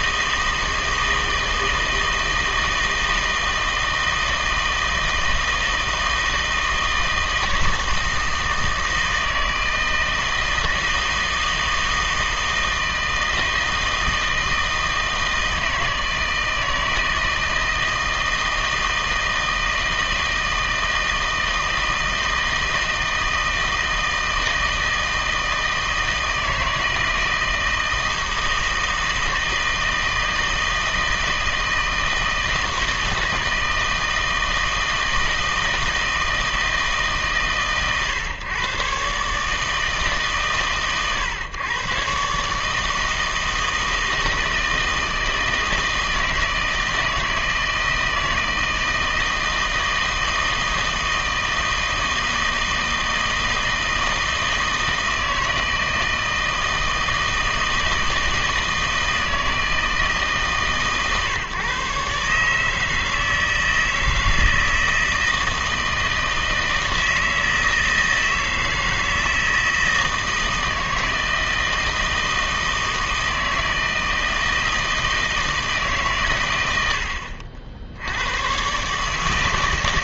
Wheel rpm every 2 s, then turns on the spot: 160, 160, 160, 160, 160, 160, 160, 160, 160, 160, 160, 160, 160, 160, 160, 160, 160, 160, 160, 130, 130, 150, 160, 160, 160, 160, 160, 160, 160, 160, 140, 150, 160, 160, 160, 160, 160, 160, 90, 140.
none